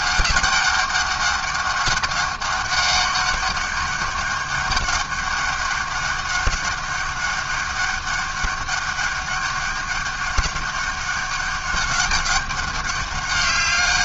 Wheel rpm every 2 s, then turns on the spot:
200, 200, 200, 200, 200, 200, 200.
none